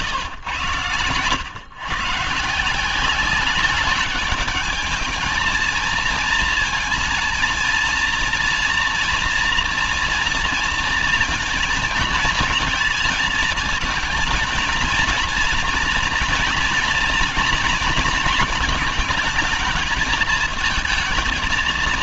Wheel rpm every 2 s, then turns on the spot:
120, 190, 220, 230, 240, 230, 220, 230, 240, 220, 230.
none